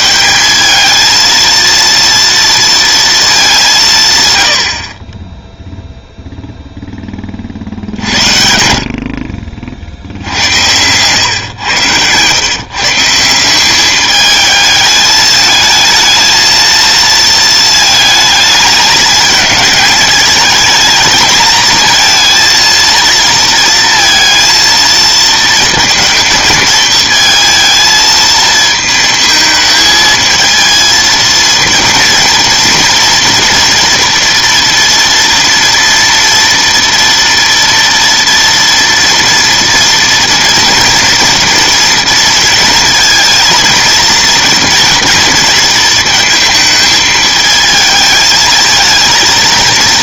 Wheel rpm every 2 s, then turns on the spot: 220, 230, 60, 10, 70, 110, 150, 220, 230, 220, 220, 230, 230, 220, 220, 230, 240, 230, 230, 230, 230, 230, 230, 220, 220.
none